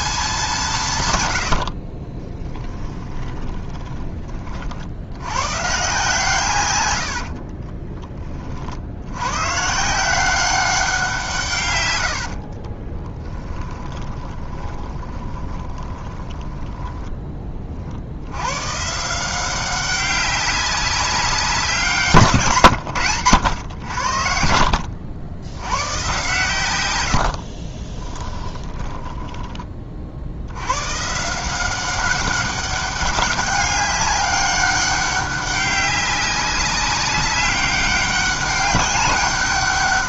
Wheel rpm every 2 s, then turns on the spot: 150, 10, 80, 100, 80, 180, 20, 20, 10, 140, 190, 120, 70, 100, 20, 130, 200, 200, 200, 200.
2-4 6-8 12-18 26-30